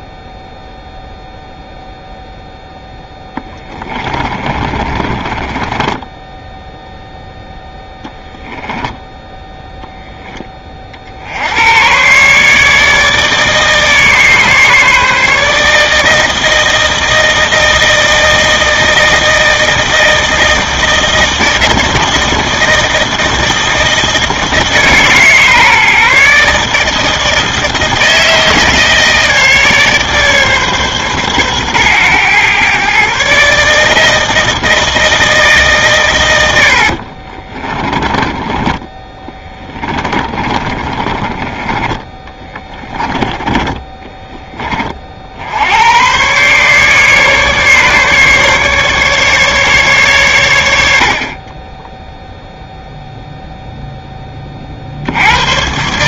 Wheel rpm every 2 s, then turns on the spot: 0, 0, 20, 0, 10, 40, 150, 150, 160, 160, 160, 160, 160, 150, 160, 140, 130, 160, 70, 20, 30, 20, 30, 140, 140, 80, 0, 50.
4-6 36-44